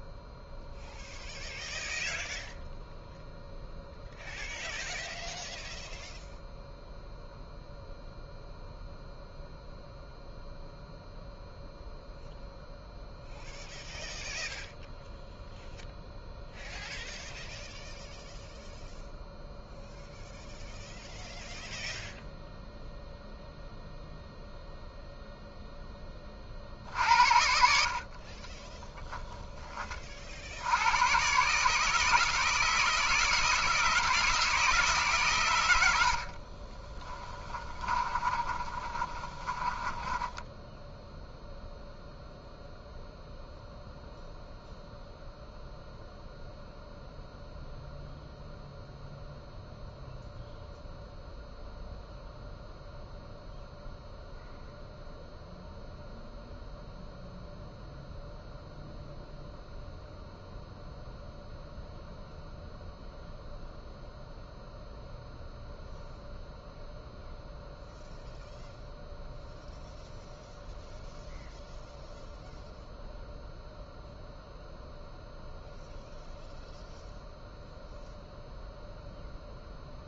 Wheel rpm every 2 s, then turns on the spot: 0, 0, 0, 0, 0, 0, 0, 0, 0, 0, 0, 0, 0, 60, 20, 90, 160, 150, 30, 30, 10, 0, 0, 0, 0, 0, 0, 0, 0, 0, 0, 0, 0, 0, 0, 0, 0, 0, 0, 0.
28-30 36-42